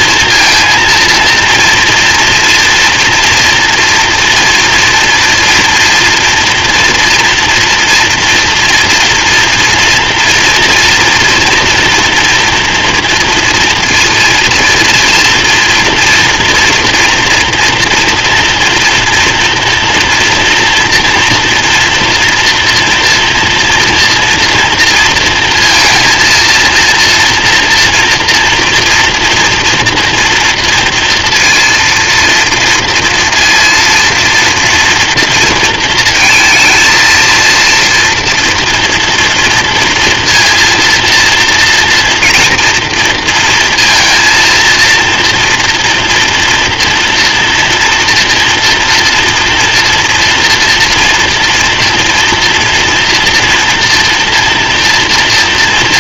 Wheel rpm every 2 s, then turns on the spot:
230, 240, 230, 240, 240, 240, 230, 230, 230, 240, 230, 230, 230, 230, 230, 230, 230, 230, 230, 230, 230, 240, 230, 230, 230, 230, 230, 230.
none